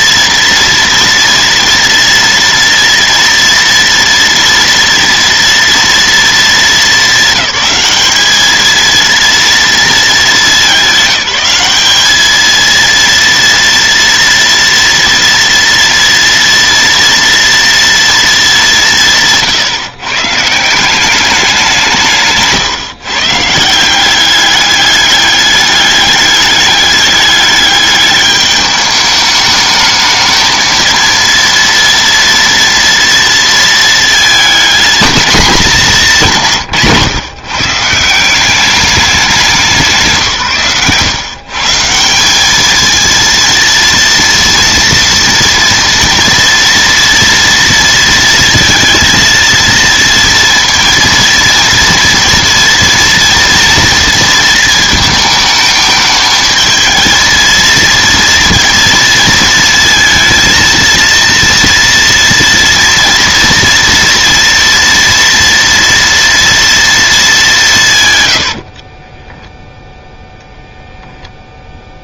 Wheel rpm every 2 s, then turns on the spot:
230, 240, 230, 210, 220, 210, 220, 230, 230, 200, 160, 150, 200, 210, 210, 220, 230, 220, 160, 190, 140, 210, 240, 230, 230, 230, 230, 230, 220, 230, 230, 230, 240, 230, 80, 0.
68-70